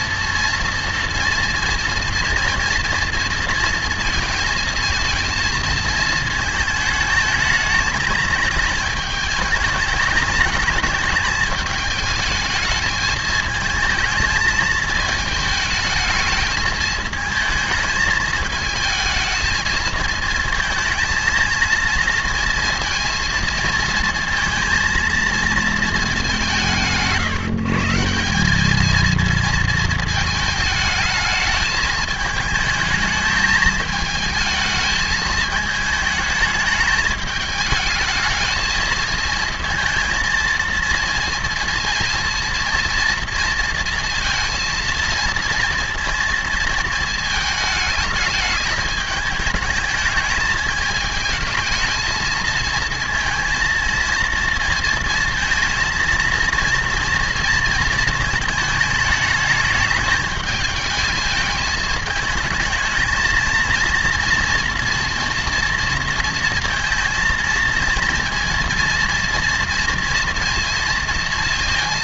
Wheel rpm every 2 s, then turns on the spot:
230, 230, 220, 220, 220, 210, 220, 220, 220, 220, 220, 230, 230, 160, 220, 220, 220, 220, 210, 220, 230, 230, 230, 220, 210, 220, 230, 230, 230, 210, 210, 220, 230, 220, 230, 230.
none